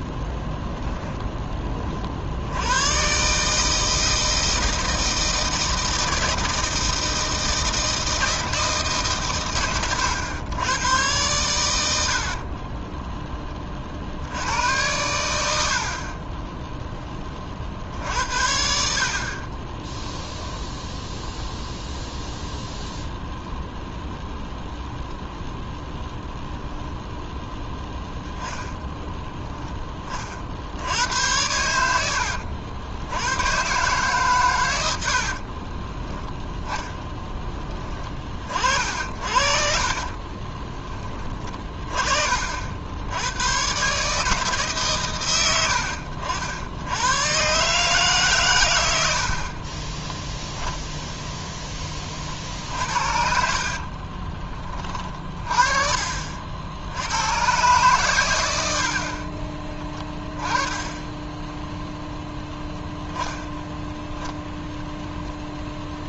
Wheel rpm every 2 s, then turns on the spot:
10, 110, 160, 160, 140, 110, 20, 90, 10, 60, 0, 0, 0, 0, 0, 80, 90, 80, 10, 50, 20, 80, 130, 90, 80, 0, 60, 30, 80, 70, 0, 0, 0.
34-36 38-40 52-54